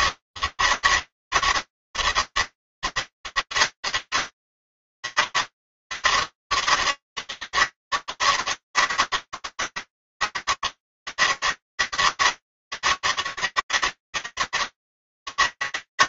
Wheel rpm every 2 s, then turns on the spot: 200, 200, 200, 200, 200, 200, 200, 200.
none